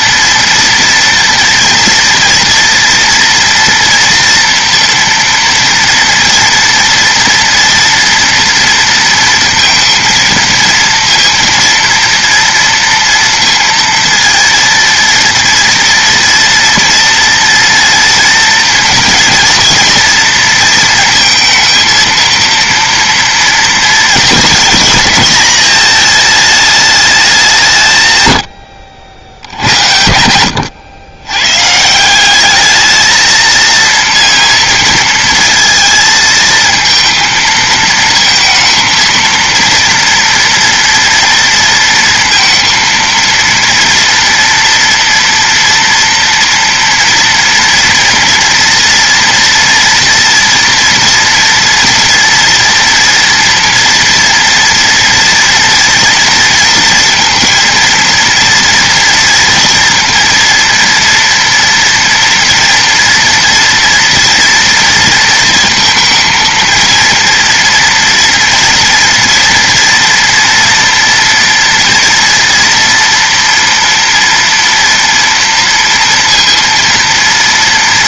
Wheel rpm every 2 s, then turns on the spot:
240, 230, 230, 230, 230, 230, 230, 230, 230, 230, 230, 230, 220, 220, 80, 90, 210, 230, 230, 230, 230, 230, 230, 230, 230, 230, 230, 230, 230, 230, 230, 230, 230, 230, 230, 240, 230, 230, 230.
none